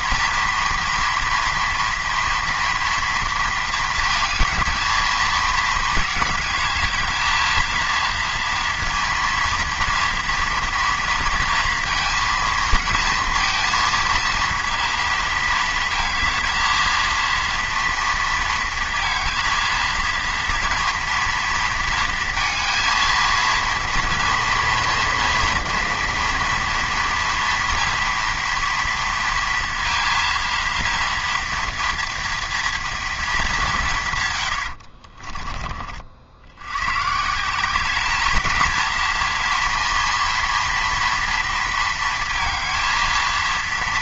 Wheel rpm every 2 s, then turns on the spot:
230, 230, 220, 210, 230, 240, 230, 230, 230, 230, 230, 230, 230, 230, 230, 230, 230, 100, 100, 220, 230, 230.
34-36